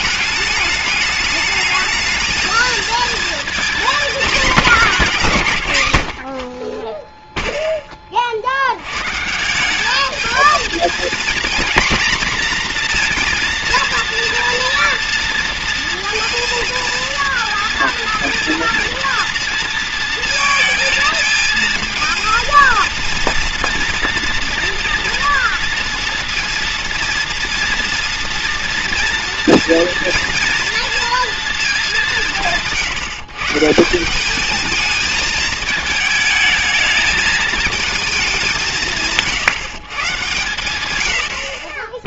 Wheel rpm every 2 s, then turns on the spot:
210, 220, 220, 40, 100, 230, 240, 230, 230, 230, 220, 230, 230, 230, 230, 230, 160, 210, 220, 160, 110.
none